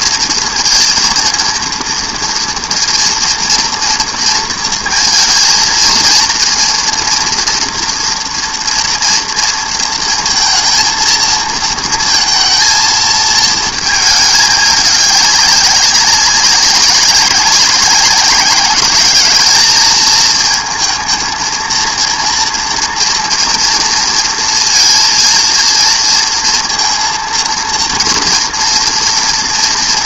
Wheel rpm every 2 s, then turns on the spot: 230, 230, 230, 230, 230, 230, 230, 210, 190, 200, 220, 230, 230, 230, 230.
none